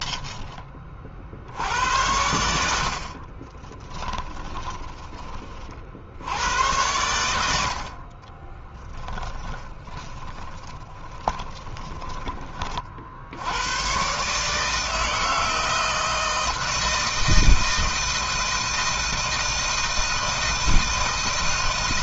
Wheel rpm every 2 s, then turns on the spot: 40, 60, 20, 100, 10, 10, 50, 160, 160, 160, 160.
2-6 8-12